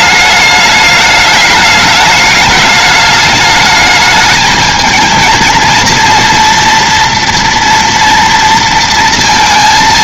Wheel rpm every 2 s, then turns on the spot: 210, 220, 220, 230, 230.
none